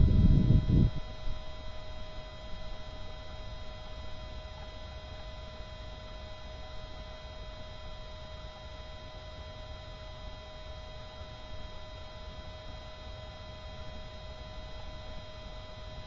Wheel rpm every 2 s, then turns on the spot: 0, 0, 0, 0, 0, 0, 0, 0.
none